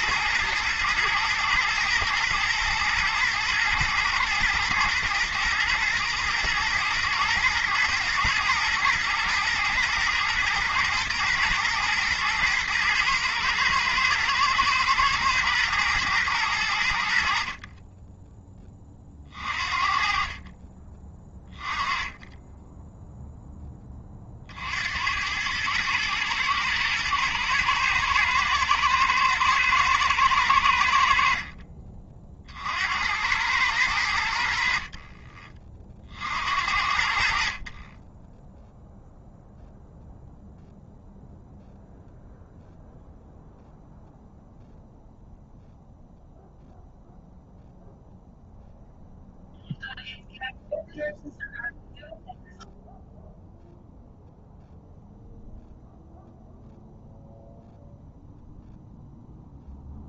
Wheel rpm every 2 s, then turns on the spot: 110, 120, 110, 120, 120, 110, 120, 110, 90, 20, 30, 10, 60, 110, 110, 100, 60, 60, 60, 10, 0, 0, 0, 0, 0, 0, 0, 0, 0, 0.
none